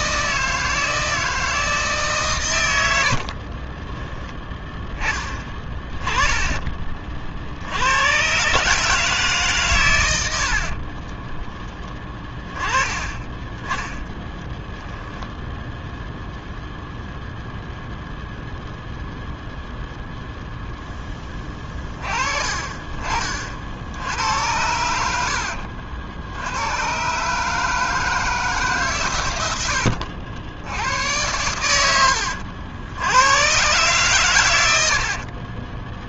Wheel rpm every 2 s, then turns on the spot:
160, 110, 10, 20, 150, 50, 20, 0, 0, 0, 0, 30, 80, 110, 140, 80, 70, 80.
2-4 10-12 34-36